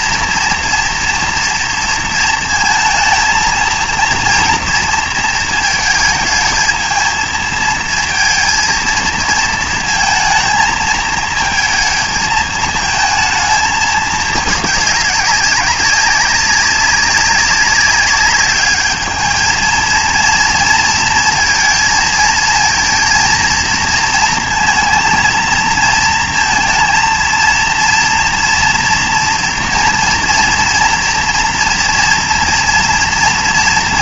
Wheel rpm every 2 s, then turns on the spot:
230, 230, 230, 220, 220, 220, 220, 200, 190, 200, 230, 230, 230, 230, 230, 230, 240.
none